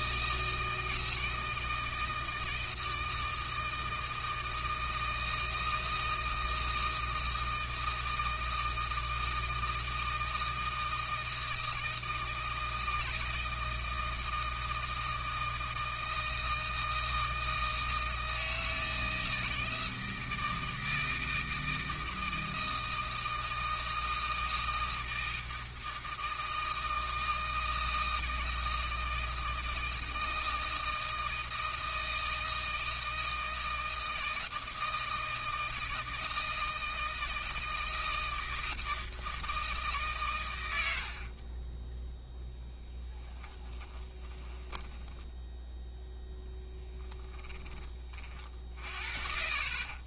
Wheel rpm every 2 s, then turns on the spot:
160, 160, 160, 160, 160, 160, 160, 160, 160, 160, 160, 160, 160, 160, 160, 160, 160, 160, 160, 160, 100, 0, 10, 10, 50.
44-46